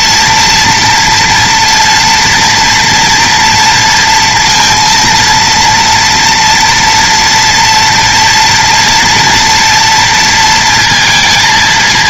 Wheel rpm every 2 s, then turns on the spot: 230, 240, 230, 230, 230, 230.
none